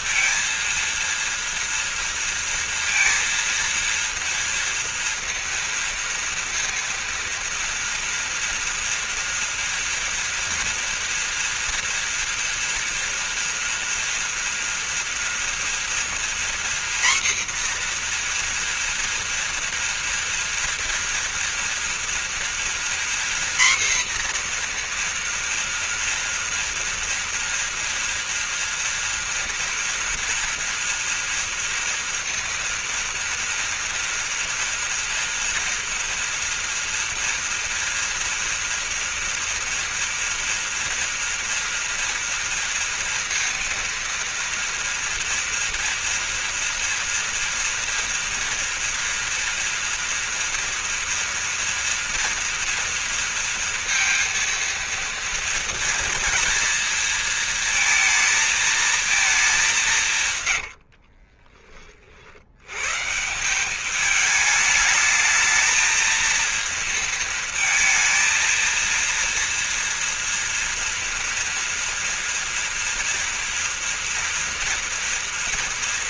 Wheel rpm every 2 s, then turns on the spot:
230, 230, 230, 230, 230, 230, 230, 230, 250, 240, 230, 240, 240, 230, 240, 230, 230, 230, 230, 230, 230, 230, 230, 230, 230, 230, 240, 230, 230, 230, 80, 110, 220, 230, 230, 230, 230, 230.
60-62